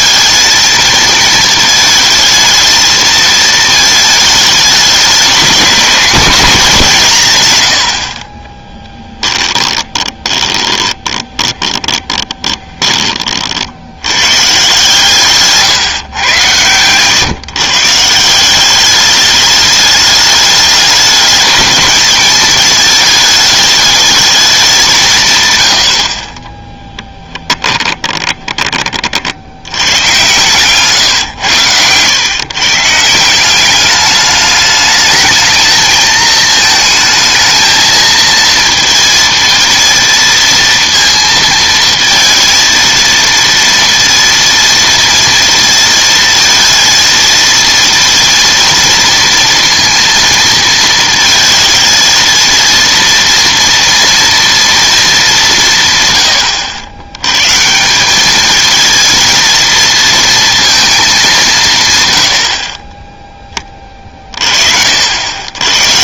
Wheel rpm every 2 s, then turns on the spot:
220, 220, 210, 200, 20, 20, 20, 140, 110, 190, 210, 220, 190, 20, 30, 120, 140, 210, 220, 230, 230, 230, 230, 230, 230, 230, 230, 230, 90, 220, 230, 40, 60.
8-14 26-28